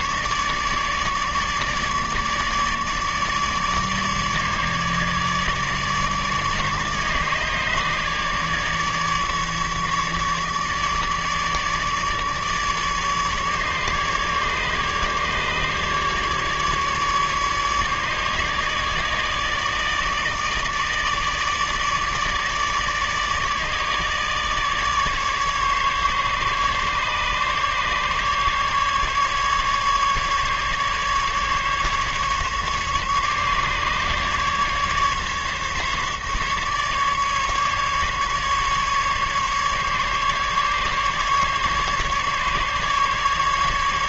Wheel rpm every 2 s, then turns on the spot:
150, 150, 150, 150, 150, 150, 150, 150, 150, 150, 150, 150, 150, 140, 150, 150, 140, 150, 150, 140, 150, 140.
none